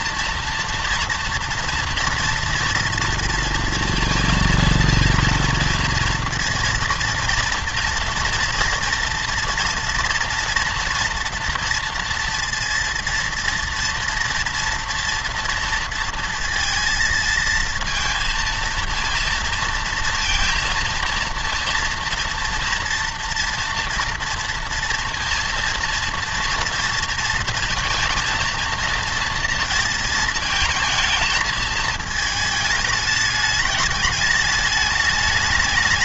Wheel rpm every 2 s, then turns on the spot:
230, 230, 230, 230, 230, 230, 230, 230, 230, 230, 230, 230, 240, 230, 230, 220, 220, 210.
none